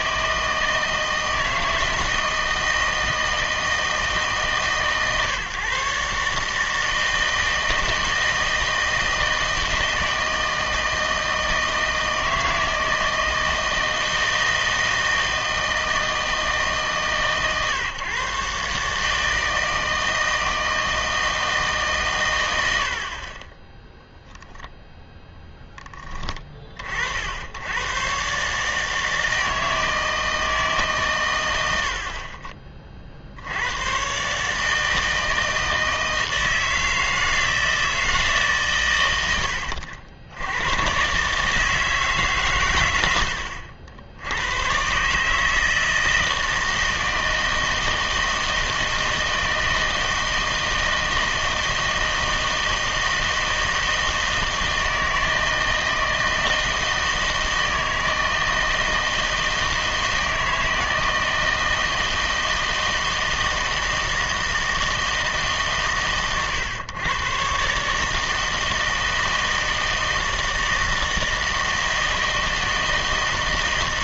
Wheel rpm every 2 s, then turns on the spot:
160, 160, 150, 160, 160, 160, 160, 160, 150, 140, 160, 80, 10, 40, 150, 160, 30, 150, 160, 140, 100, 120, 110, 160, 160, 160, 160, 160, 160, 160, 160, 160, 160, 120, 160, 160, 160.
22-26